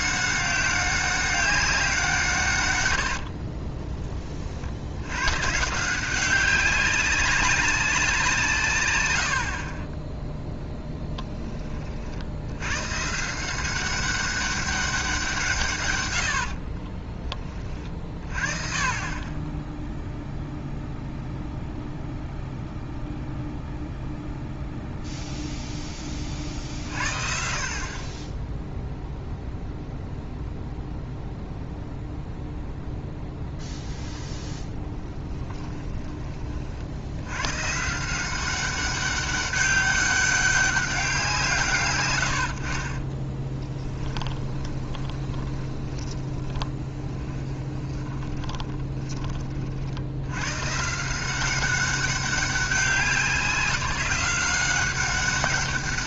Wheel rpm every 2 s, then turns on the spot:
190, 120, 70, 190, 130, 0, 120, 200, 50, 40, 0, 0, 0, 50, 0, 0, 0, 10, 50, 190, 200, 60, 20, 20, 20, 130, 190, 180.
2-4 16-18 34-36 42-50